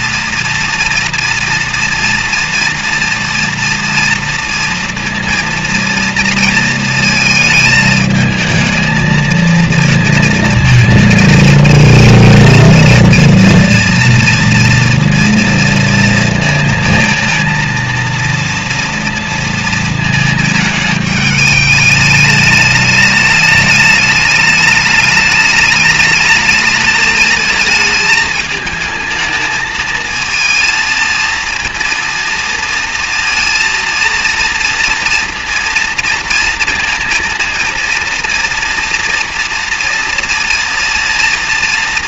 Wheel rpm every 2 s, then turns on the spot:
230, 230, 230, 230, 220, 220, 230, 230, 230, 230, 220, 210, 210, 220, 220, 220, 230, 230, 230, 230, 230.
none